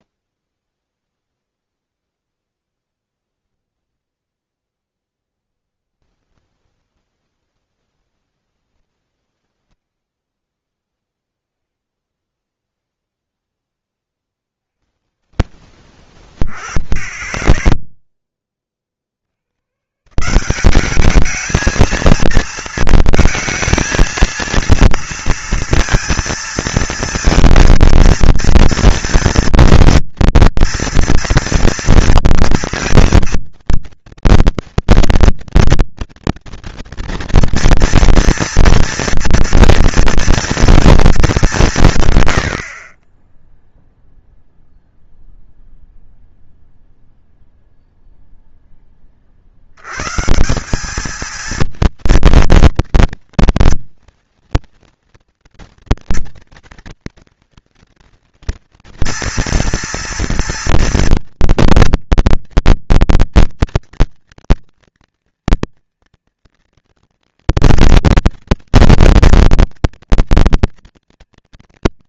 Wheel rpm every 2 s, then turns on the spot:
0, 10, 10, 20, 10, 10, 10, 50, 10, 20, 190, 230, 230, 230, 230, 230, 230, 240, 230, 230, 230, 80, 0, 0, 0, 170, 230, 230, 230, 230, 240, 230, 240, 230, 230, 230.
2-8